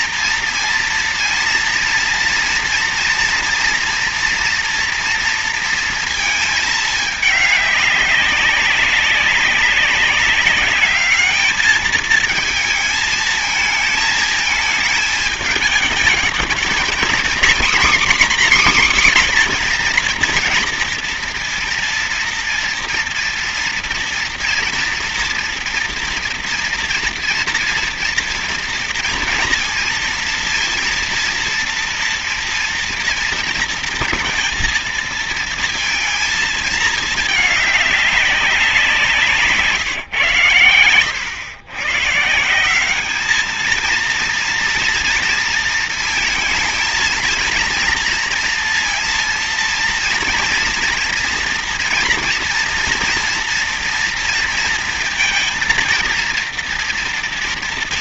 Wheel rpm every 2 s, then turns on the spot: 230, 230, 230, 210, 200, 210, 220, 220, 230, 270, 240, 230, 230, 230, 230, 230, 230, 230, 220, 180, 110, 190, 230, 230, 230, 230, 230, 230, 230.
none